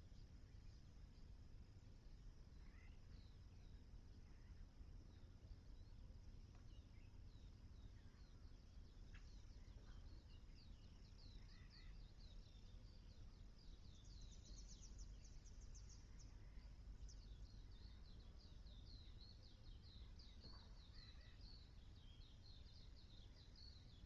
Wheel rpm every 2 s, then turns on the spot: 0, 0, 0, 0, 0, 0, 0, 0, 0, 0, 0, 0.
none